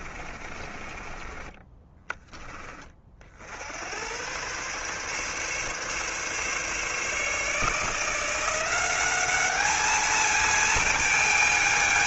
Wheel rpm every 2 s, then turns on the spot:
30, 30, 130, 140, 180, 220.
0-2